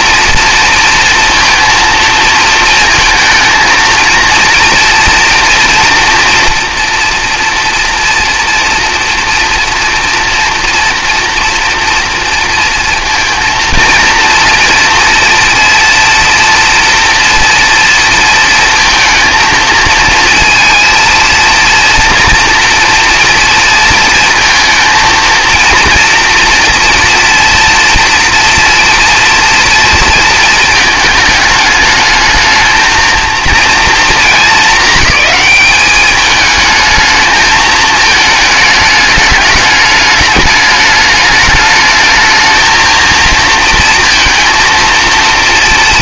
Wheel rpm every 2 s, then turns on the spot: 230, 230, 230, 230, 230, 230, 230, 230, 230, 230, 230, 230, 230, 240, 230, 220, 220, 220, 220, 210, 210, 230, 230.
none